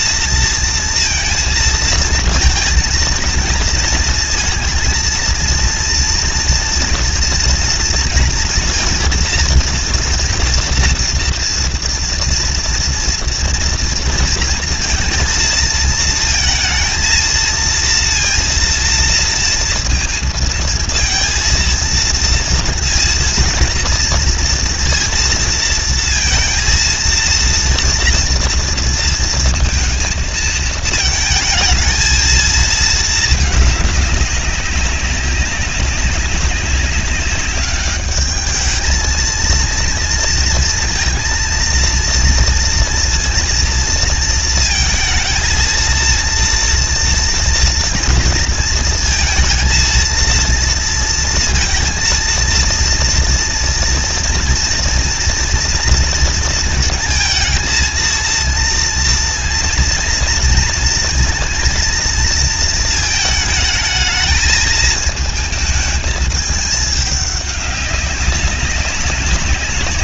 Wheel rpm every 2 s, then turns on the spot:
230, 220, 230, 230, 240, 230, 230, 230, 230, 230, 230, 230, 230, 230, 230, 220, 220, 200, 200, 210, 230, 230, 230, 230, 230, 230, 230, 230, 230, 230, 230, 230, 220, 220, 200.
none